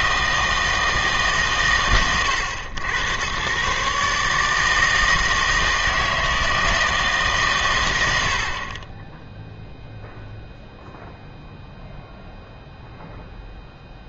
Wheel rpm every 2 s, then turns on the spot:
160, 90, 160, 160, 40, 0, 0.
none